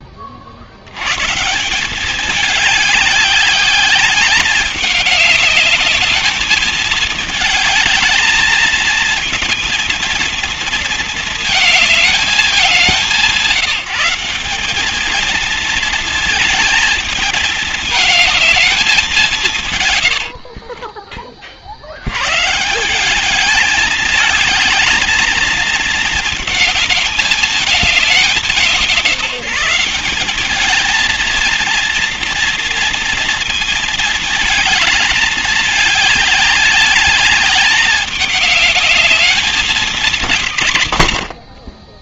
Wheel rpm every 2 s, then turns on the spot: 80, 200, 190, 210, 220, 230, 190, 200, 220, 220, 50, 180, 220, 220, 170, 210, 230, 220, 200, 210, 130.
20-22